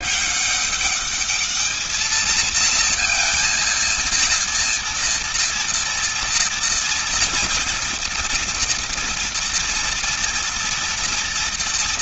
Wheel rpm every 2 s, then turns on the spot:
200, 230, 230, 230, 230, 230.
none